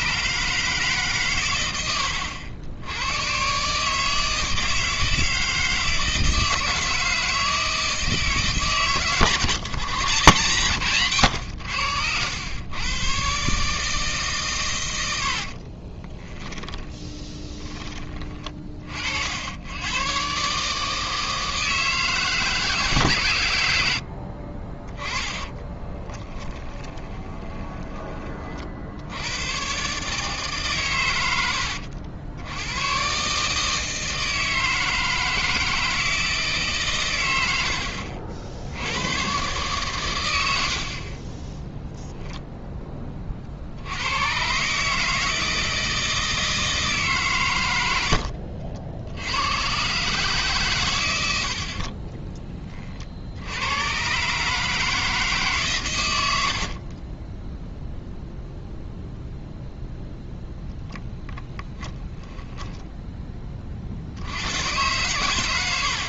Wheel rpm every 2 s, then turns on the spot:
150, 90, 160, 160, 130, 130, 120, 110, 30, 40, 150, 150, 30, 20, 60, 140, 110, 160, 140, 80, 60, 20, 150, 150, 70, 120, 30, 160, 40, 0, 10, 10, 100.
16-18 26-28 56-58 62-64